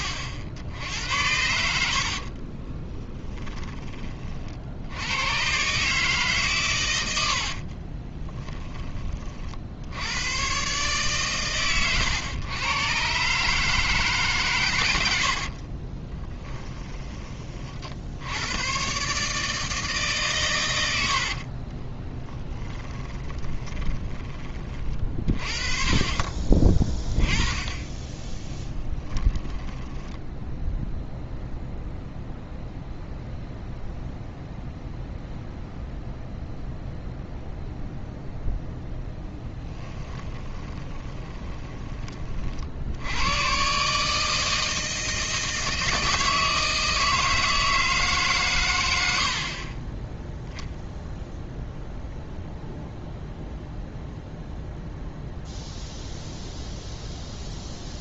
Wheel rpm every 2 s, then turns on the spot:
70, 30, 70, 130, 20, 130, 120, 110, 20, 120, 100, 10, 30, 20, 20, 0, 0, 0, 0, 0, 20, 60, 160, 160, 100, 0, 0, 0, 0.
2-4 22-24 28-30 40-42